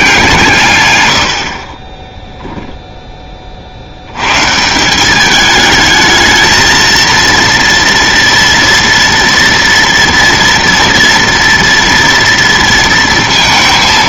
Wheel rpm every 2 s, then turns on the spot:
140, 0, 140, 220, 230, 230, 230.
none